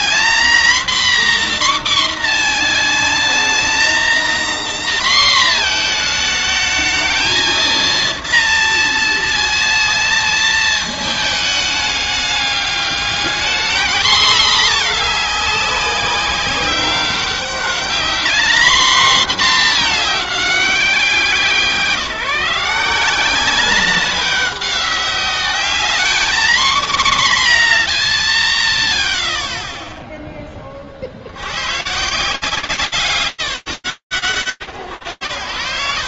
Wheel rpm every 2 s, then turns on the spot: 250, 240, 250, 220, 230, 220, 210, 240, 190, 230, 200, 180, 190, 220, 40, 50, 150, 110.
none